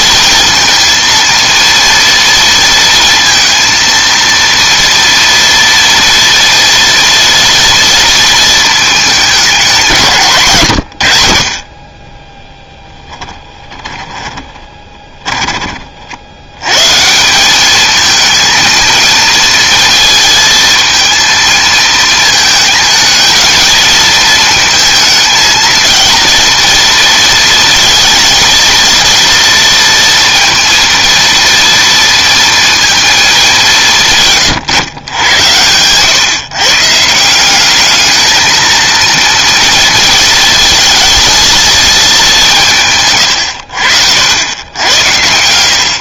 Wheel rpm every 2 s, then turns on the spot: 230, 230, 230, 230, 220, 90, 10, 20, 120, 230, 230, 220, 220, 230, 230, 230, 230, 120, 140, 220, 220, 160, 90.
12-16